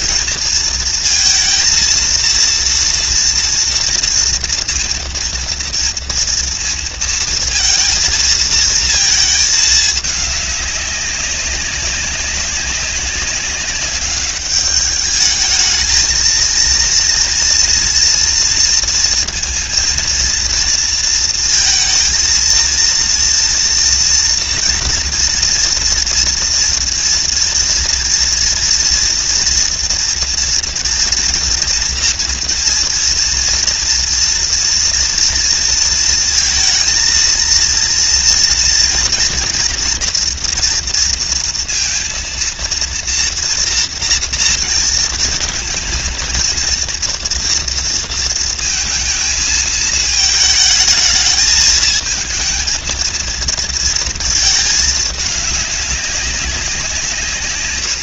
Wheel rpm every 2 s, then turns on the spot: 230, 230, 230, 230, 220, 200, 200, 210, 230, 230, 230, 230, 230, 230, 230, 230, 230, 230, 230, 240, 230, 230, 230, 230, 230, 220, 230, 210, 160.
none